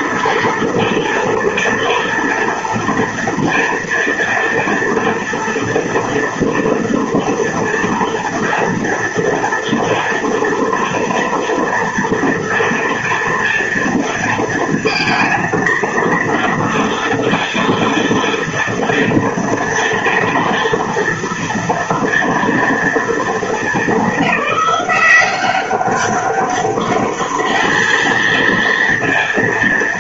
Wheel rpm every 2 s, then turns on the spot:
230, 230, 230, 230, 230, 230, 230, 230, 230, 230, 230, 230, 200, 200, 230.
none